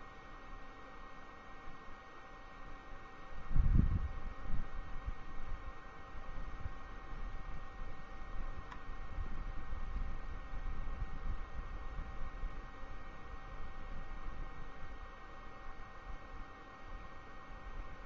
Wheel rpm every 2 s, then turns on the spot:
0, 0, 0, 0, 0, 0, 0, 0, 0.
none